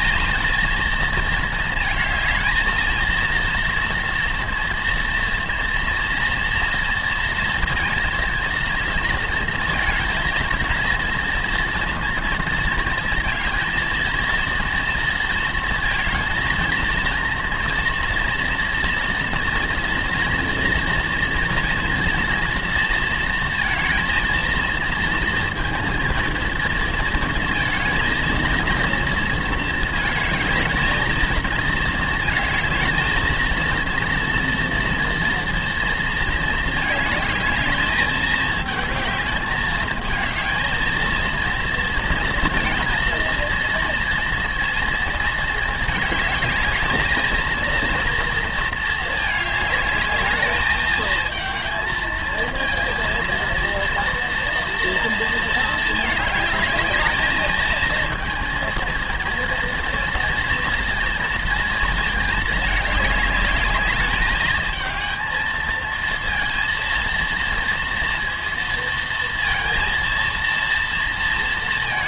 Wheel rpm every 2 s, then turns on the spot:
230, 220, 230, 230, 230, 230, 230, 230, 230, 230, 230, 230, 230, 230, 230, 220, 220, 230, 220, 220, 230, 230, 230, 220, 220, 220, 230, 230, 220, 230, 230, 210, 220, 230, 230, 230.
none